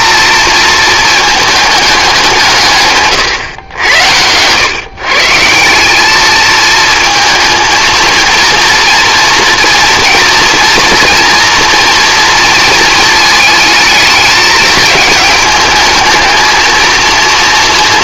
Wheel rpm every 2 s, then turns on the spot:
230, 140, 130, 220, 230, 230, 230, 210, 220.
none